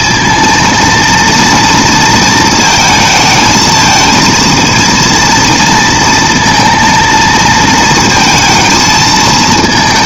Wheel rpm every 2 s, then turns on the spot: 230, 220, 230, 230, 220.
none